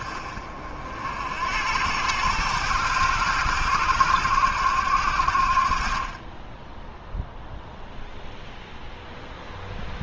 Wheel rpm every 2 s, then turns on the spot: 60, 110, 80, 0, 0.
none